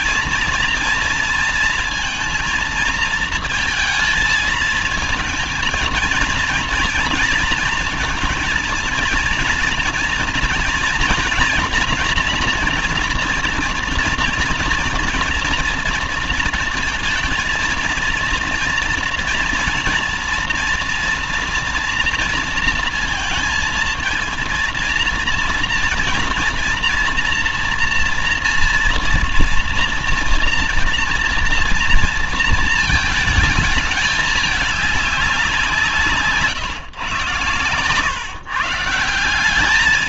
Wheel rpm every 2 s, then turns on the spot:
240, 230, 220, 230, 230, 230, 230, 230, 220, 230, 240, 230, 230, 230, 230, 230, 230, 210, 140, 140.
none